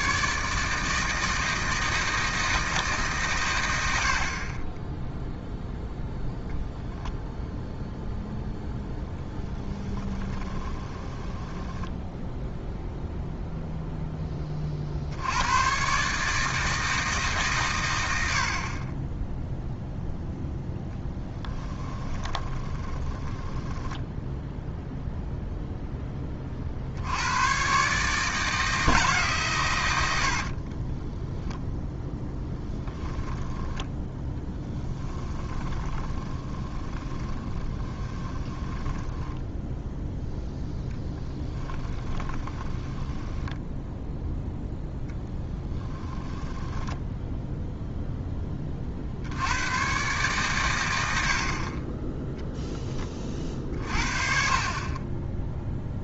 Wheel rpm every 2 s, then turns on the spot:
160, 160, 20, 0, 0, 10, 0, 50, 160, 40, 10, 10, 0, 50, 160, 30, 10, 10, 20, 10, 0, 10, 0, 10, 30, 100, 10, 30.
10-12 20-24 30-40 42-44 46-48